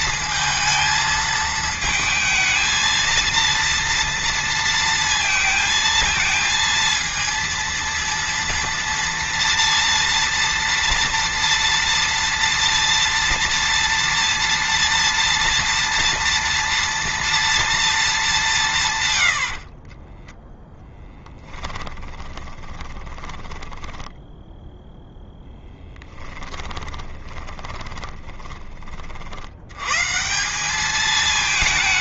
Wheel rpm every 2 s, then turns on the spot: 220, 220, 230, 230, 230, 230, 230, 230, 230, 130, 10, 20, 0, 20, 40, 200.
20-24 26-28